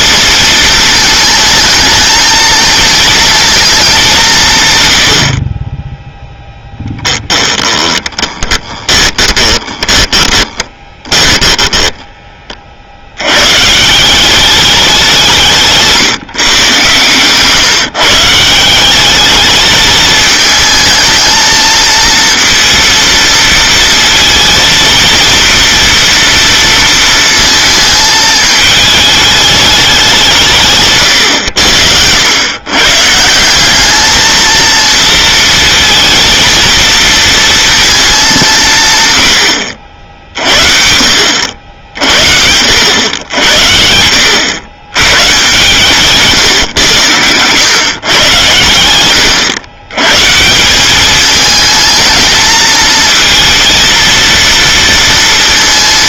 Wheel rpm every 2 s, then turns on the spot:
230, 230, 130, 10, 20, 20, 40, 200, 120, 180, 220, 230, 230, 230, 220, 140, 120, 230, 230, 160, 50, 80, 100, 140, 110, 180, 220, 230.
6-12